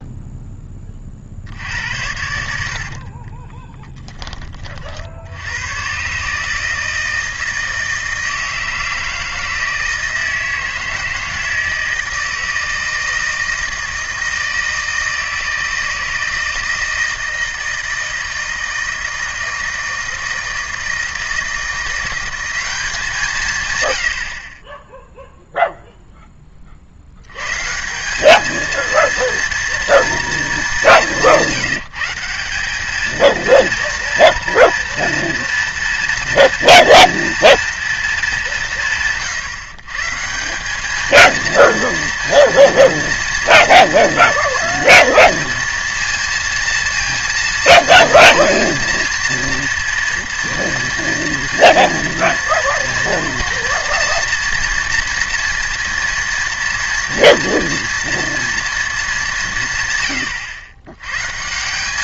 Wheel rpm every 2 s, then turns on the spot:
40, 50, 60, 160, 160, 160, 160, 160, 160, 160, 160, 180, 0, 80, 230, 190, 210, 230, 230, 170, 210, 230, 230, 230, 230, 230, 230, 230, 230, 220, 120.
2-4